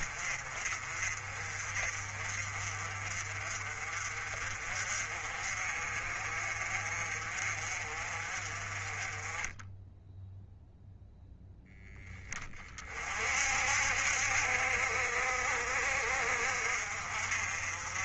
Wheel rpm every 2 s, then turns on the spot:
40, 40, 40, 40, 30, 0, 50, 60, 50.
none